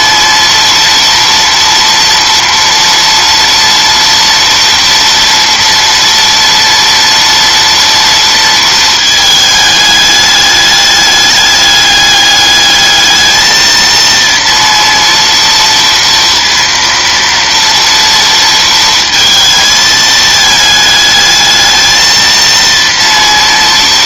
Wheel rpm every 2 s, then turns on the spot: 230, 230, 230, 230, 220, 210, 220, 230, 230, 230, 210, 230.
none